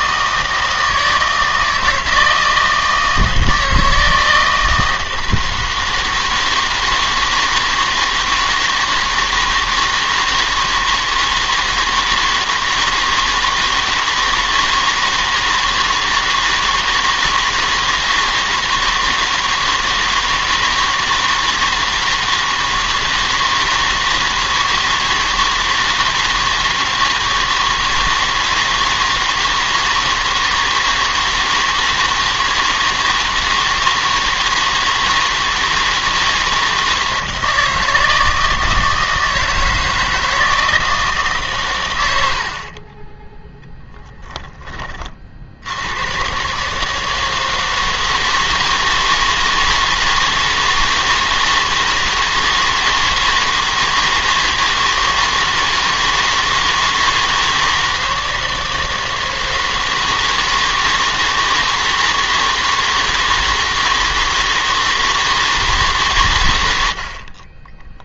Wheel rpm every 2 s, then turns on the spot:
160, 160, 160, 160, 160, 160, 160, 160, 160, 160, 160, 160, 160, 160, 160, 160, 160, 160, 160, 160, 160, 40, 20, 150, 160, 160, 160, 160, 160, 160, 160, 160, 160, 100.
42-44